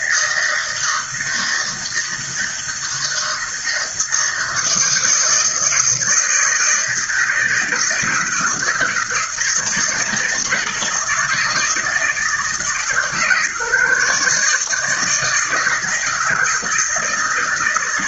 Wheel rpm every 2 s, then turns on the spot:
160, 160, 160, 160, 160, 160, 140, 150, 160.
none